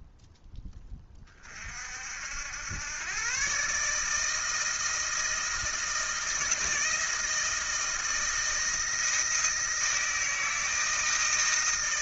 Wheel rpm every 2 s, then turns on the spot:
10, 110, 160, 160, 160, 160.
none